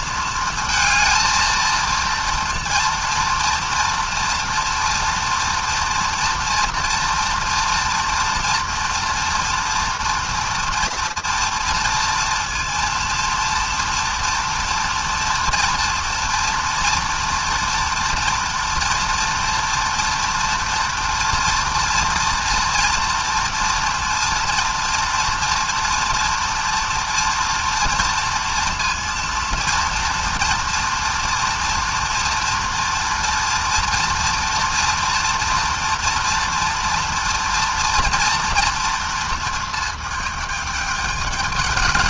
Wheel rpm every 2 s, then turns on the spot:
230, 230, 230, 240, 240, 230, 230, 230, 230, 240, 230, 240, 230, 230, 230, 230, 230, 230, 230, 230, 210.
none